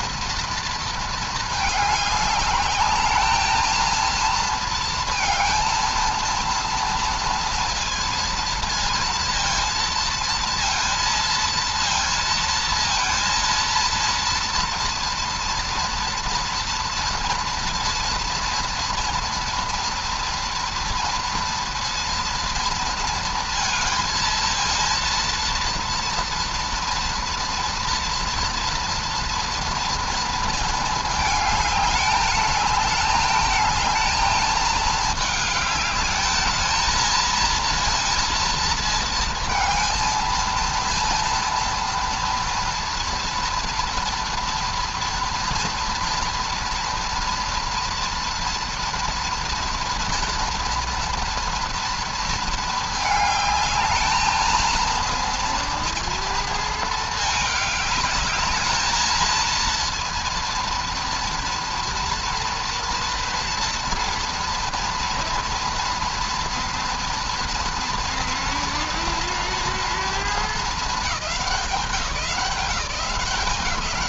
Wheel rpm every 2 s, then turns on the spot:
230, 210, 230, 230, 230, 230, 230, 230, 230, 230, 230, 230, 230, 230, 230, 220, 210, 220, 220, 220, 230, 230, 230, 230, 230, 230, 220, 230, 220, 220, 230, 230, 230, 230, 230, 210, 170.
none